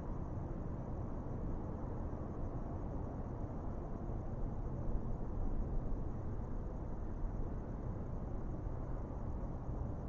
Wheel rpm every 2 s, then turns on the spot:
0, 0, 0, 0, 0.
none